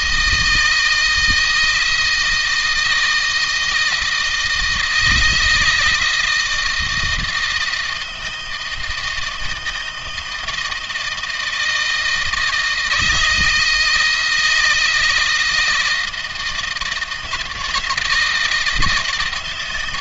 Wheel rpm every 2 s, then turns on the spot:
160, 160, 160, 160, 160, 160, 160, 160, 160, 160.
none